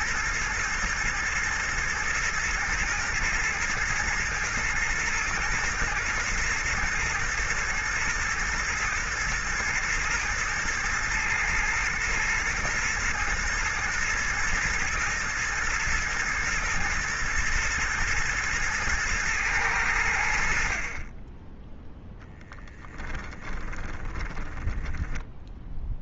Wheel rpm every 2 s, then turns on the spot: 110, 110, 120, 110, 110, 110, 110, 120, 120, 110, 30, 20, 20.
22-26